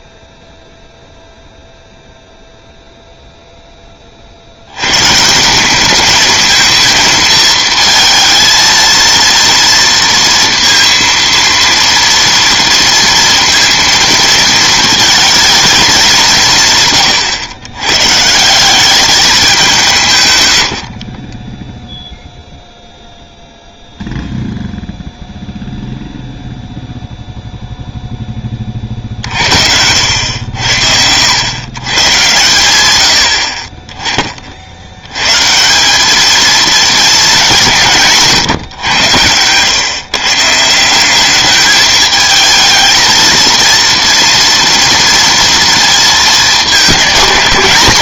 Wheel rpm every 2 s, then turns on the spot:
0, 0, 150, 220, 230, 230, 230, 220, 110, 210, 50, 0, 0, 0, 70, 110, 30, 160, 180, 120, 210, 230, 230, 180.
none